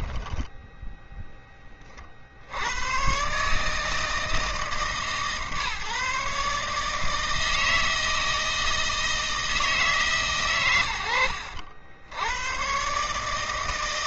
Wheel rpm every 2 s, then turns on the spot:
20, 150, 150, 160, 150, 80, 160.
none